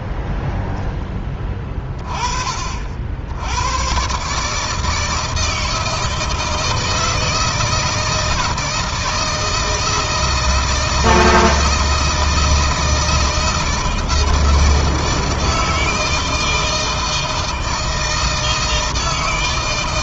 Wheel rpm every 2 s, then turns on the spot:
10, 60, 150, 160, 160, 160, 160, 160, 160, 160.
none